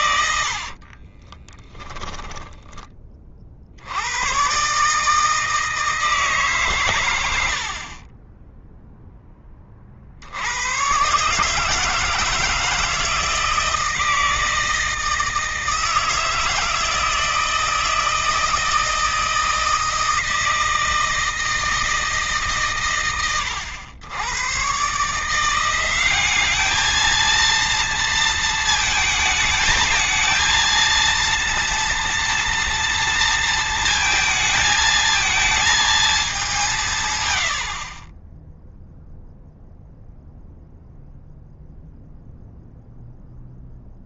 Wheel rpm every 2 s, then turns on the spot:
30, 40, 160, 100, 10, 140, 160, 160, 160, 160, 160, 120, 150, 220, 220, 230, 230, 220, 120, 0, 0, 0.
0-2